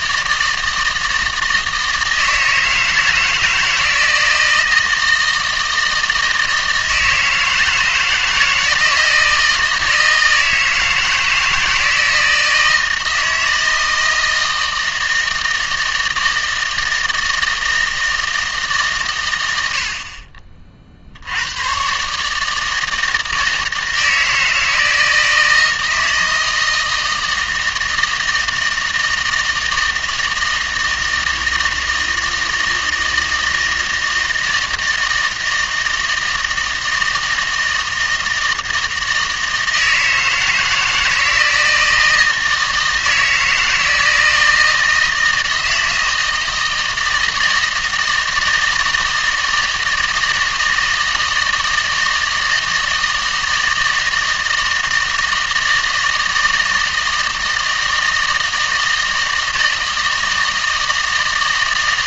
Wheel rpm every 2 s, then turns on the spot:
160, 160, 160, 160, 160, 160, 160, 160, 160, 140, 50, 160, 160, 160, 160, 160, 160, 160, 160, 160, 160, 160, 160, 160, 160, 160, 160, 160, 160, 160, 160.
none